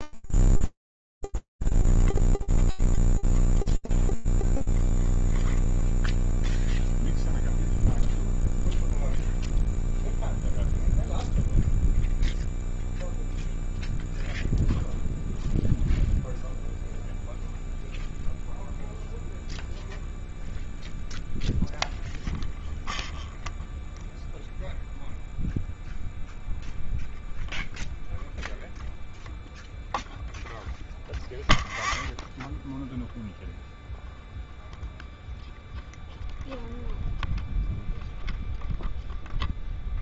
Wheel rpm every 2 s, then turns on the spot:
0, 0, 0, 0, 0, 0, 0, 0, 0, 0, 0, 0, 0, 0, 0, 0, 0, 0, 0, 0.
none